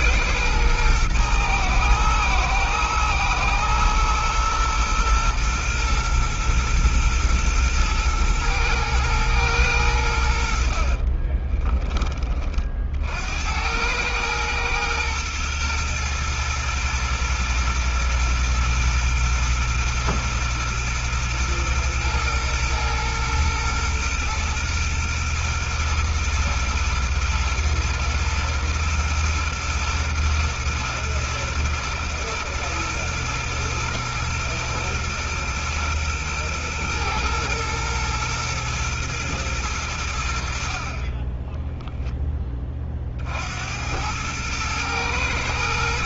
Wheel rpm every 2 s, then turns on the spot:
120, 120, 120, 120, 120, 60, 40, 110, 120, 120, 120, 120, 120, 120, 120, 120, 120, 120, 120, 120, 50, 30, 110.
10-12